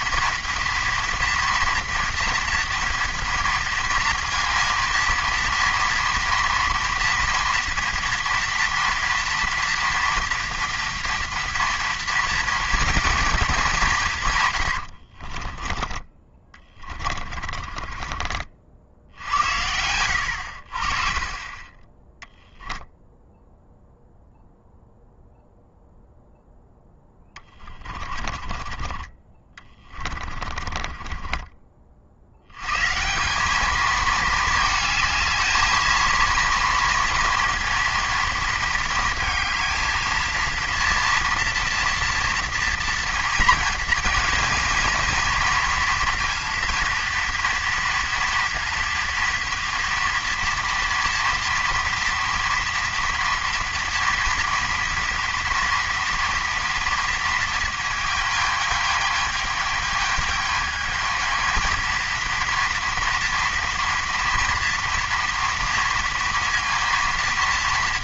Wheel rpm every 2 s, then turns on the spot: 230, 230, 230, 230, 230, 230, 230, 100, 20, 60, 50, 0, 0, 10, 30, 30, 140, 220, 230, 230, 230, 230, 240, 230, 230, 240, 230, 230, 230, 220, 220, 230, 230, 230.
14-18 26-32